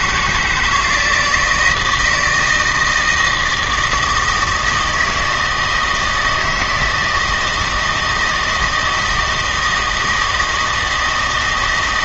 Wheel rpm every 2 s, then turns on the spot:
160, 160, 160, 160, 170, 160.
none